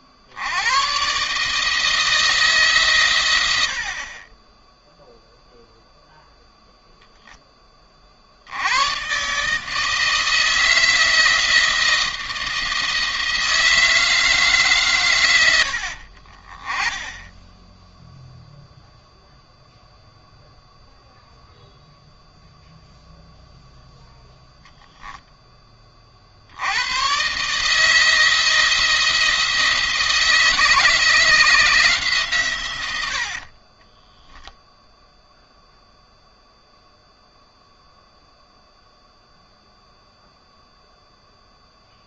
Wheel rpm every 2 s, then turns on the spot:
120, 120, 0, 0, 120, 170, 160, 120, 10, 0, 0, 0, 0, 110, 160, 160, 100, 0, 0, 0, 0.
none